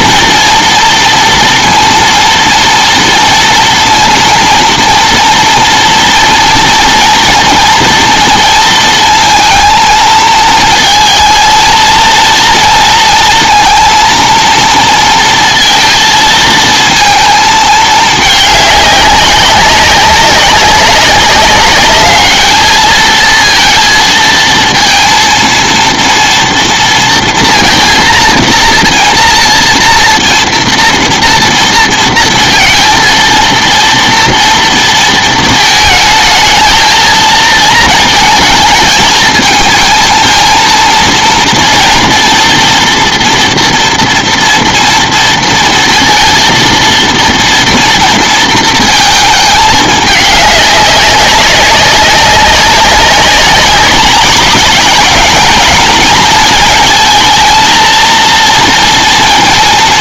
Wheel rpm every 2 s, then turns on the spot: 230, 230, 230, 230, 230, 220, 230, 230, 230, 210, 190, 220, 230, 230, 230, 230, 230, 230, 220, 220, 230, 230, 240, 230, 230, 200, 190, 210, 230, 230.
none